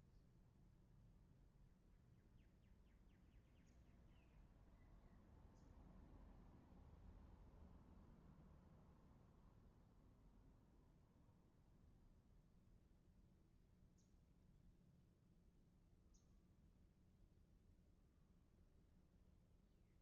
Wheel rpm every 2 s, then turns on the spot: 0, 0, 0, 0, 0, 0, 0, 0, 0, 0.
none